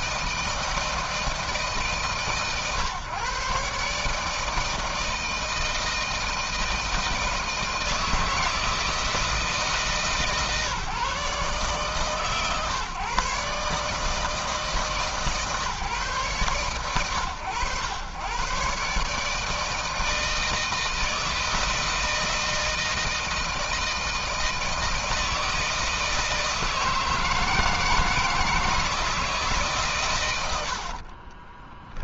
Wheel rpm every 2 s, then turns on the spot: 160, 140, 160, 160, 160, 140, 130, 150, 120, 140, 160, 160, 160, 160, 160, 60.
30-32